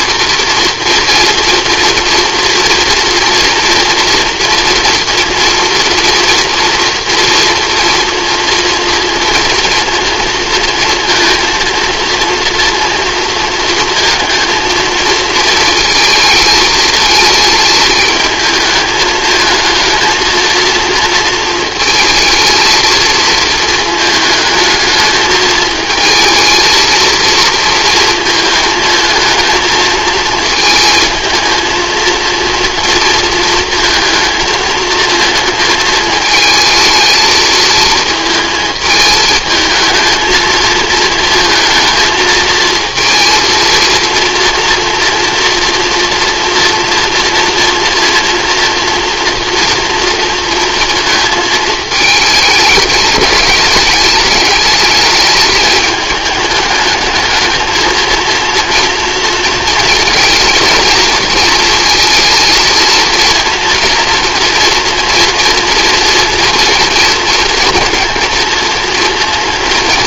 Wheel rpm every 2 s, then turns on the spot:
240, 240, 230, 230, 230, 230, 230, 230, 220, 220, 220, 220, 220, 230, 220, 230, 230, 220, 220, 220, 230, 230, 230, 240, 230, 230, 210, 210, 210, 230, 230, 230, 230, 230, 230.
none